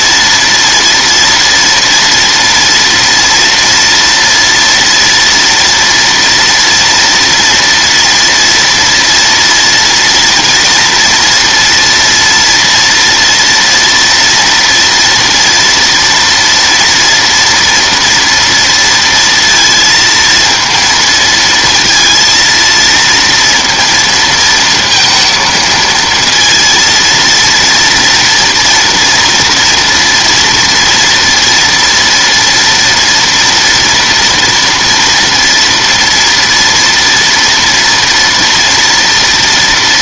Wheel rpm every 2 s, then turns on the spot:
230, 230, 230, 240, 230, 230, 230, 230, 230, 230, 230, 230, 230, 230, 230, 240, 230, 230, 230, 230.
none